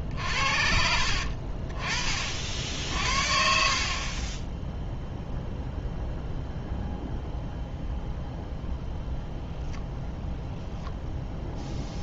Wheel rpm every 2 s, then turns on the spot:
60, 50, 10, 0, 0, 0.
4-6